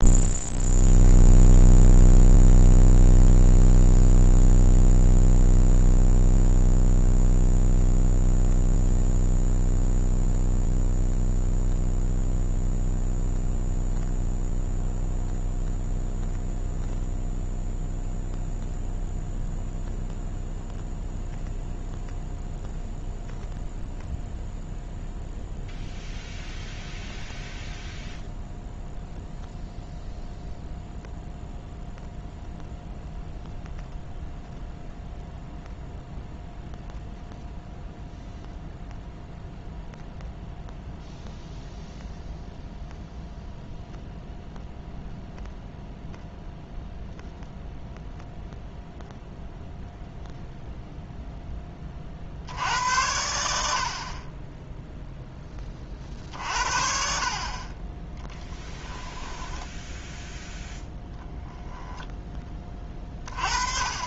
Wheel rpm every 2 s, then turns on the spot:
0, 0, 0, 0, 0, 0, 0, 0, 0, 0, 0, 0, 0, 0, 0, 0, 0, 0, 0, 0, 0, 0, 0, 0, 0, 0, 70, 10, 50, 10, 0, 20.
58-60